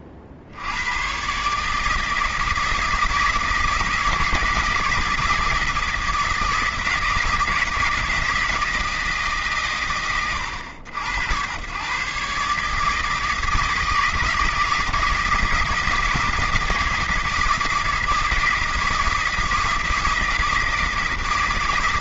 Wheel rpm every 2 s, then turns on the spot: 70, 160, 160, 160, 160, 90, 150, 160, 160, 160, 160.
none